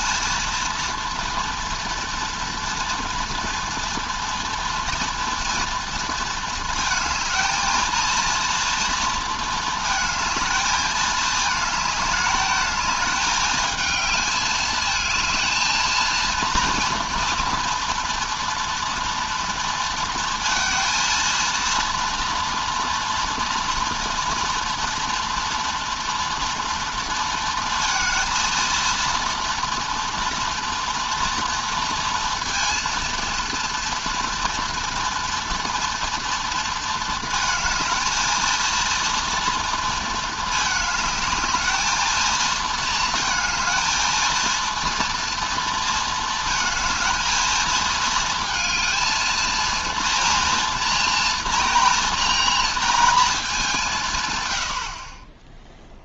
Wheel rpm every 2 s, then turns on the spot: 230, 230, 230, 230, 230, 220, 210, 220, 230, 230, 230, 230, 230, 230, 230, 230, 230, 230, 230, 220, 210, 220, 230, 220, 230, 230, 230, 80.
none